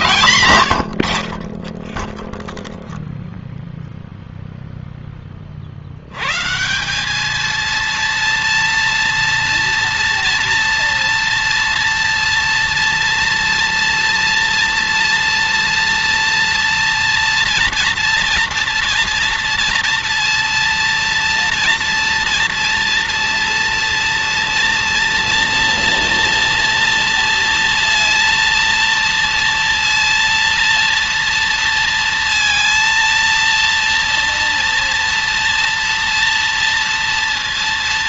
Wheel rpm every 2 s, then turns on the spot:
100, 0, 40, 220, 230, 230, 230, 230, 230, 230, 230, 230, 230, 230, 230, 230, 230, 230, 230.
none